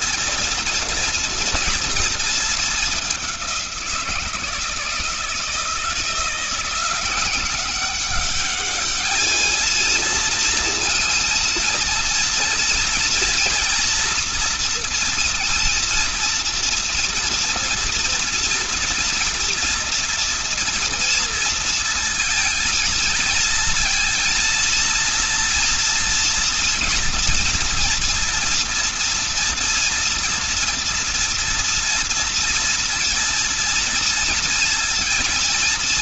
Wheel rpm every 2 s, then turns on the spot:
230, 200, 170, 170, 210, 230, 230, 230, 230, 230, 230, 230, 230, 240, 240, 240, 230, 230.
none